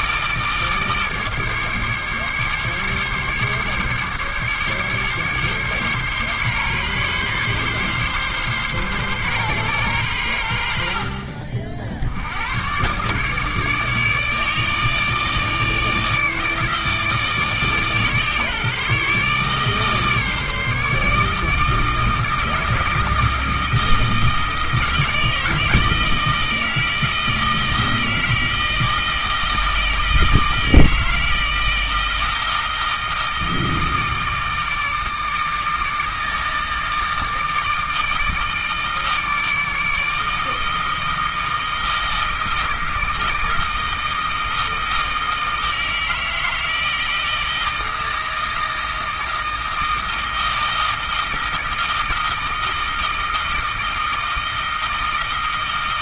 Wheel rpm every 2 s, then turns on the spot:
150, 140, 140, 140, 130, 70, 130, 150, 150, 150, 150, 160, 160, 160, 160, 160, 160, 160, 160, 160, 160, 160, 160, 160, 160, 160, 160, 160.
none